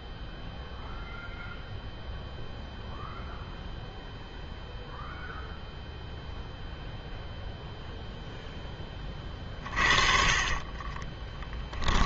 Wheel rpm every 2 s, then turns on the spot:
0, 0, 0, 0, 10, 30.
10-12